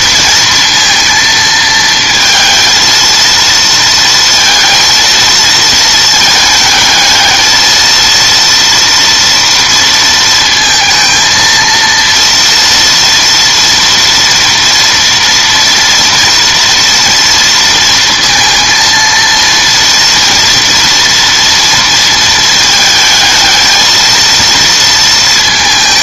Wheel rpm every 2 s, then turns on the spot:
230, 230, 230, 220, 230, 230, 230, 230, 230, 230, 230, 220, 230.
none